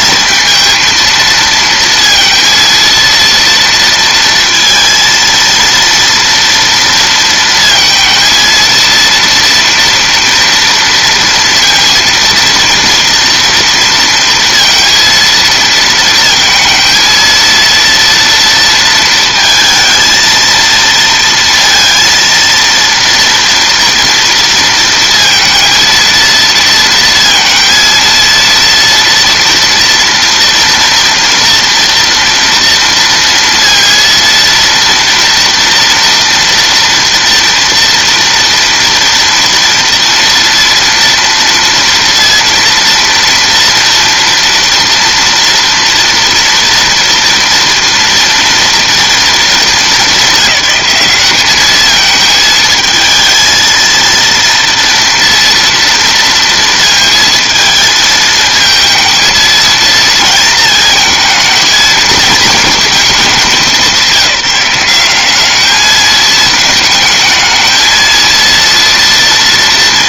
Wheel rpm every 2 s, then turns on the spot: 220, 230, 230, 230, 230, 230, 230, 230, 230, 230, 230, 230, 230, 230, 230, 230, 230, 230, 230, 230, 230, 230, 230, 240, 230, 210, 220, 230, 230, 220, 220, 210, 190, 220, 230.
none